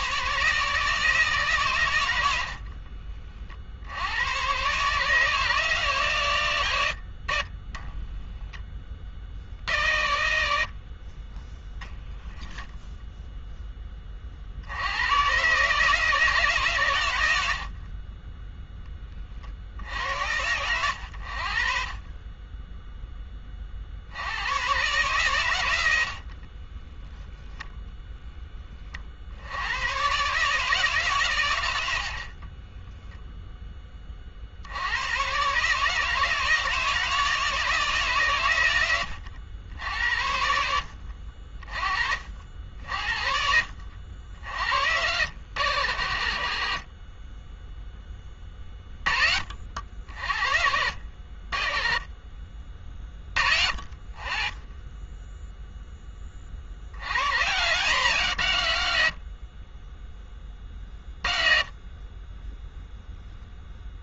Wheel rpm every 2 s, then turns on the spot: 140, 60, 120, 110, 20, 70, 10, 80, 150, 0, 90, 10, 130, 30, 20, 150, 20, 70, 160, 120, 70, 60, 70, 60, 20, 60, 20, 40, 70, 130, 30, 10.
2-4 26-28 32-34